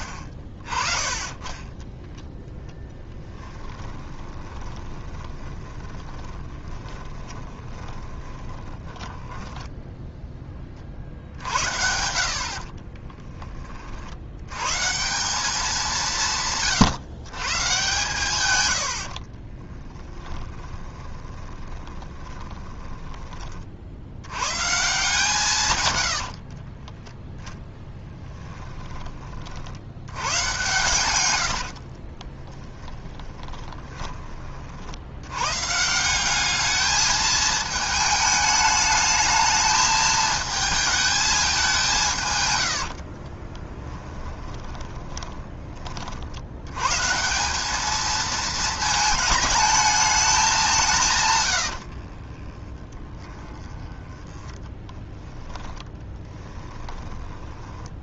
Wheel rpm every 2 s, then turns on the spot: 20, 10, 20, 20, 20, 40, 40, 140, 140, 90, 20, 10, 150, 20, 10, 120, 10, 60, 210, 210, 220, 80, 20, 120, 220, 170, 20, 10, 10.
2-10 12-14 20-24 26-28 32-34 42-46 52-58